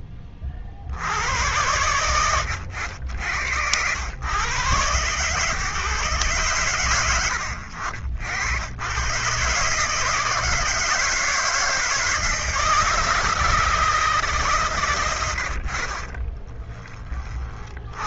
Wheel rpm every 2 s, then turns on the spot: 60, 90, 130, 90, 120, 160, 160, 110, 20.
none